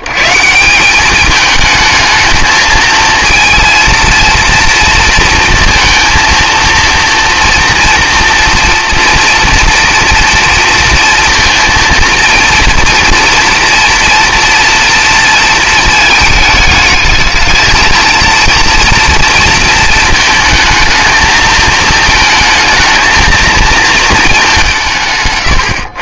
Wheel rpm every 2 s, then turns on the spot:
170, 220, 230, 230, 240, 230, 230, 230, 210, 230, 220, 220, 200.
none